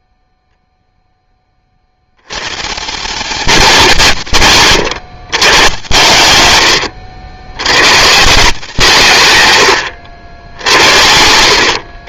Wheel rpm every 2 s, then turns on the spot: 0, 150, 140, 100, 160, 70.
10-12